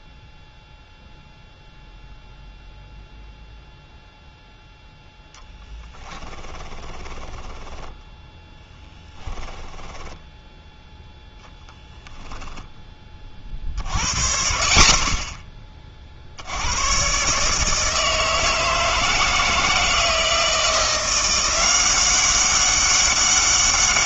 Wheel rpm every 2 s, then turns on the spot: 0, 0, 0, 20, 10, 10, 10, 60, 100, 160, 170, 200.
6-10